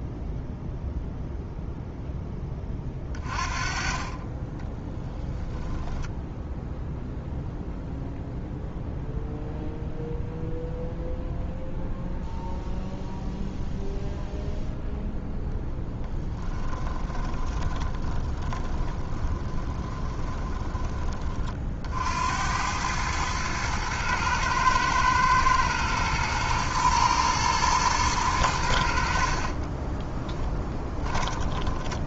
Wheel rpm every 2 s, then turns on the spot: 0, 20, 20, 0, 0, 0, 0, 0, 20, 20, 20, 90, 110, 110, 80, 10.
4-6 16-22 30-32